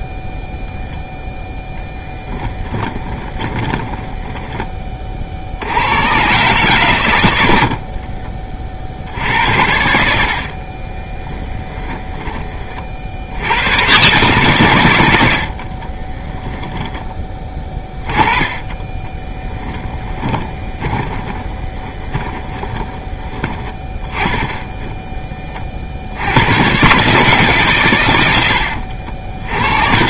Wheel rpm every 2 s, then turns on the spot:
0, 20, 20, 110, 60, 30, 50, 110, 10, 20, 20, 30, 0, 130, 80.
2-4 10-12 20-24